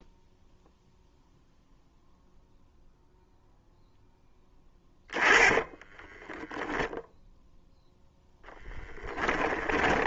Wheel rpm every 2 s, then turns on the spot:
0, 0, 10, 0, 10.
4-6 8-10